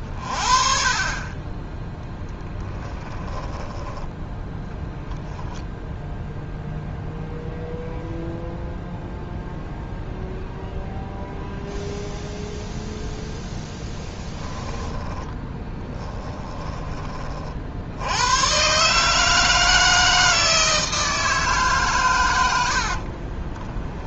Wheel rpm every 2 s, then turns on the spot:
40, 10, 10, 0, 0, 0, 0, 10, 20, 140, 160, 60.
2-4 14-16 22-24